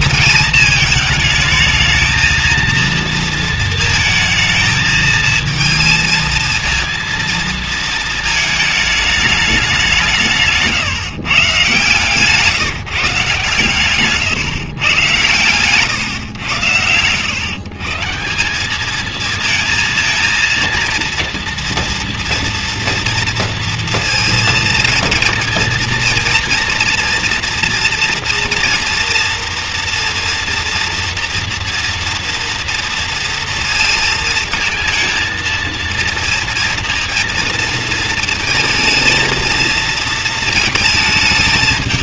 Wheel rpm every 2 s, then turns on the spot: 220, 230, 220, 230, 220, 150, 150, 140, 110, 190, 230, 230, 230, 230, 240, 230, 230, 220, 230, 220, 230.
none